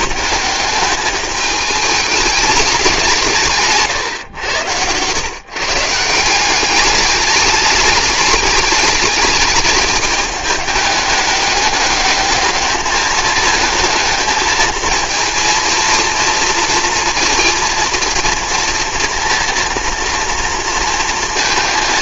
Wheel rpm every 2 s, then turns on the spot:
200, 200, 120, 200, 210, 210, 210, 220, 230, 230, 230.
4-6